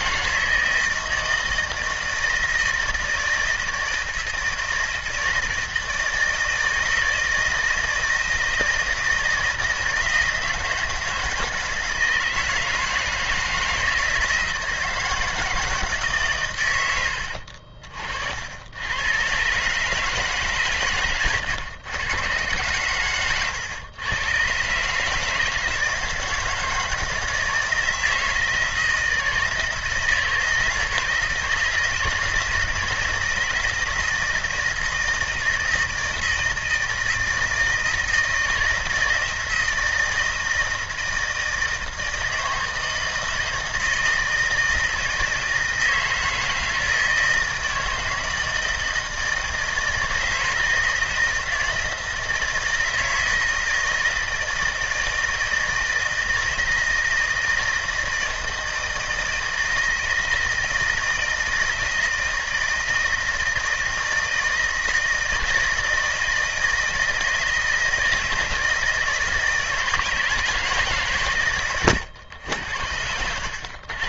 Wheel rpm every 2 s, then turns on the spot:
160, 160, 160, 160, 160, 160, 160, 160, 90, 100, 120, 120, 140, 160, 160, 160, 160, 160, 160, 160, 160, 160, 160, 160, 160, 160, 160, 160, 160, 160, 160, 160, 160, 160, 160, 150, 90.
none